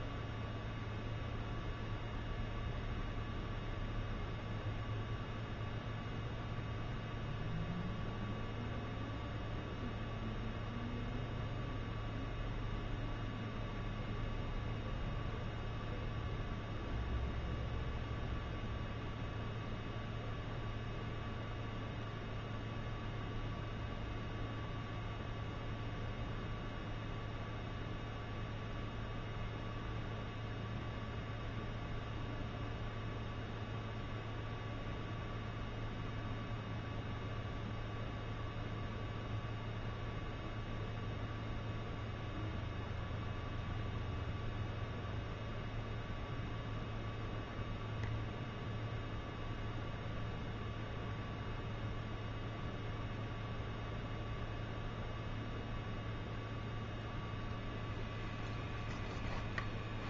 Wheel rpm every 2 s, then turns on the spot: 0, 0, 0, 10, 0, 0, 0, 0, 0, 0, 0, 0, 0, 0, 0, 0, 0, 0, 0, 0, 0, 0, 0, 0, 0, 0, 0, 0, 0, 0.
none